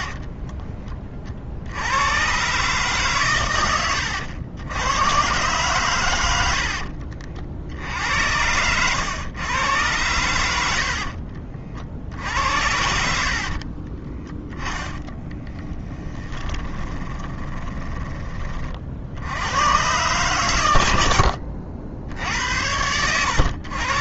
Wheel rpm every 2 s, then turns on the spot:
30, 140, 100, 70, 100, 80, 80, 10, 20, 40, 110, 90.
6-8 10-18 22-24